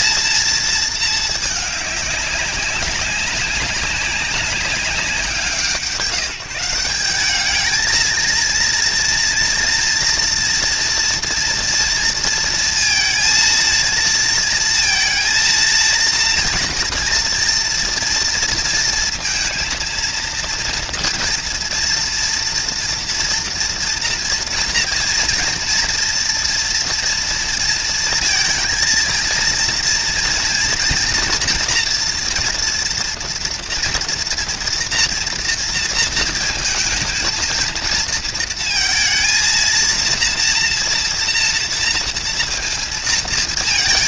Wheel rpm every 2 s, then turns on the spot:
230, 200, 190, 170, 230, 230, 230, 230, 230, 230, 230, 230, 230, 230, 230, 230, 230, 240, 220, 230, 240, 230.
none